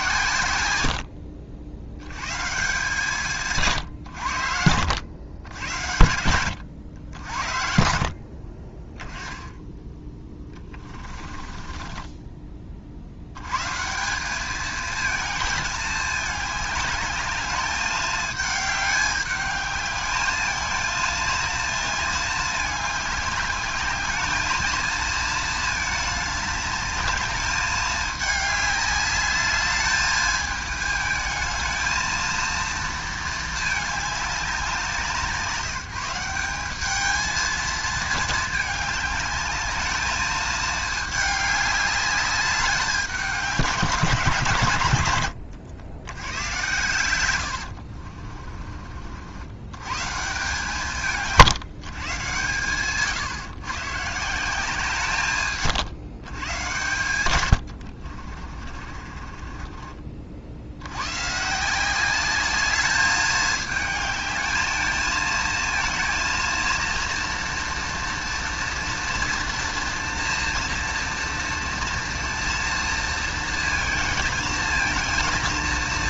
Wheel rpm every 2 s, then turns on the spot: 100, 160, 80, 90, 30, 20, 40, 210, 210, 210, 220, 210, 220, 210, 210, 220, 230, 170, 200, 210, 220, 200, 130, 110, 50, 160, 130, 170, 120, 50, 90, 210, 220, 230, 230, 230, 230, 230.
0-2 4-6 10-12 58-60